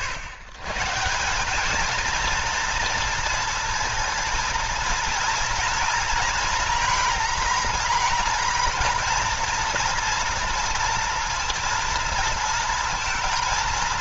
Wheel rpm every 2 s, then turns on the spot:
40, 230, 230, 230, 240, 230, 230.
none